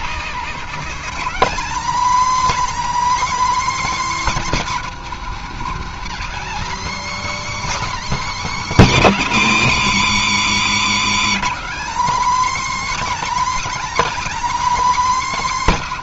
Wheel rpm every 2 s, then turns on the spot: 240, 310, 270, 260, 280, 170, 310, 300.
0-2 10-12